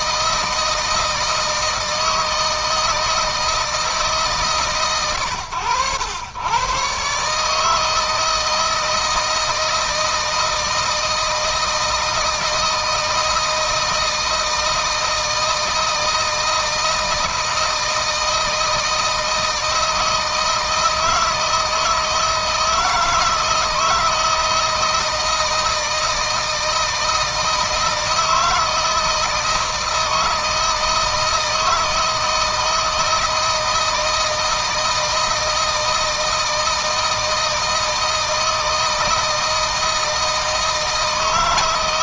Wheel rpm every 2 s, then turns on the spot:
160, 160, 130, 130, 160, 160, 160, 160, 160, 160, 160, 160, 160, 160, 160, 160, 160, 160, 160, 160, 160.
none